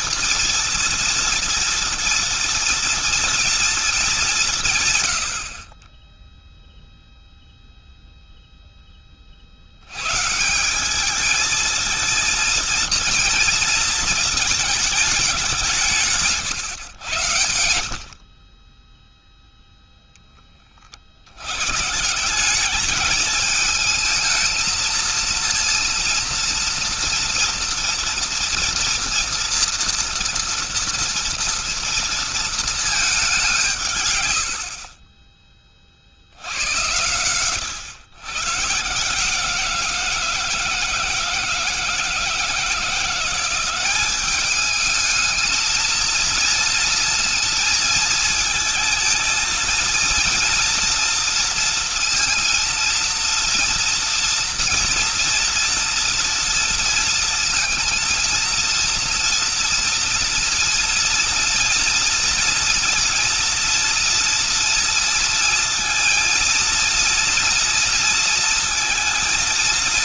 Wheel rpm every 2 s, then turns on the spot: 230, 230, 180, 0, 0, 170, 230, 220, 160, 30, 20, 180, 220, 230, 230, 230, 220, 80, 80, 140, 160, 170, 210, 230, 230, 230, 230, 230, 230, 230, 230, 230, 230, 230, 230.
none